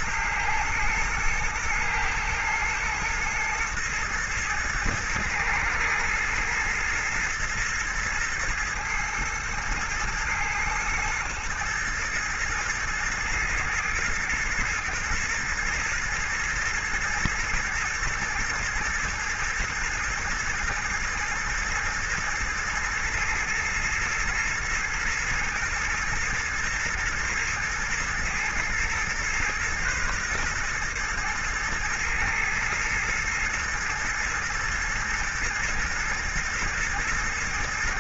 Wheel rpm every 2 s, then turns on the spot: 110, 110, 110, 110, 110, 110, 110, 120, 110, 120, 120, 110, 110, 120, 120, 120, 110, 110, 120.
none